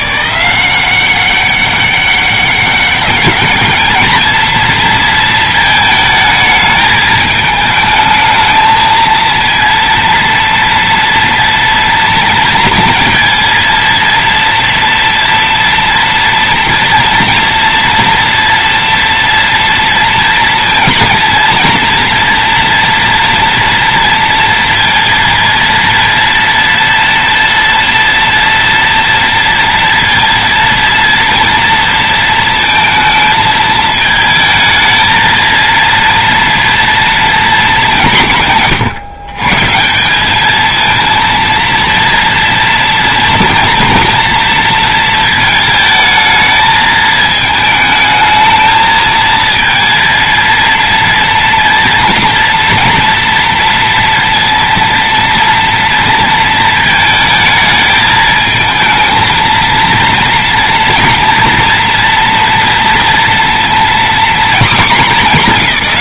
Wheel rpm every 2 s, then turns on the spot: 190, 200, 230, 220, 220, 230, 230, 230, 230, 240, 230, 230, 230, 230, 230, 230, 220, 220, 230, 140, 220, 230, 230, 220, 220, 230, 230, 230, 220, 220, 230, 230, 220.
none